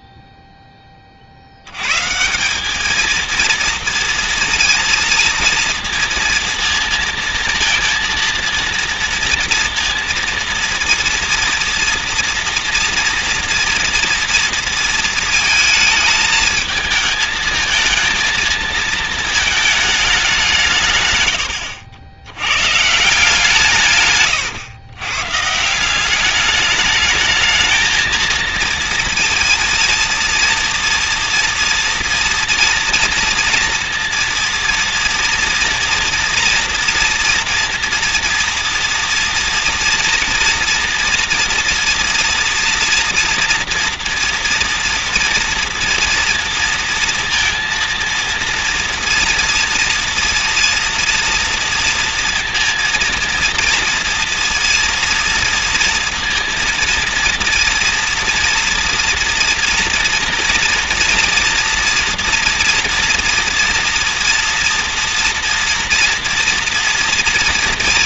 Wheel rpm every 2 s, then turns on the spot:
10, 190, 230, 230, 230, 230, 230, 230, 220, 220, 160, 120, 120, 210, 230, 230, 230, 230, 230, 230, 230, 230, 230, 230, 230, 230, 230, 230, 230, 230, 230, 230, 230, 230.
none